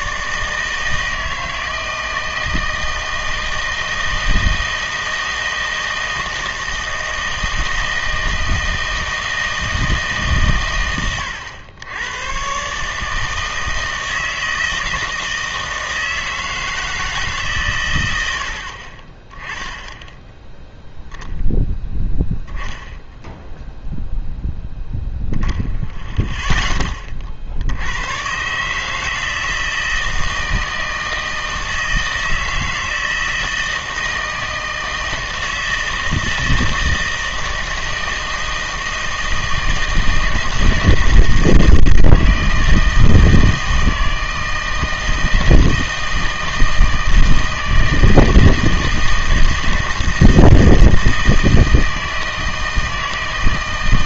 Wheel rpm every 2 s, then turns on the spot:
160, 160, 160, 160, 160, 120, 140, 160, 160, 40, 10, 0, 0, 10, 150, 160, 160, 160, 160, 160, 160, 160, 160, 160, 160, 160, 160.
none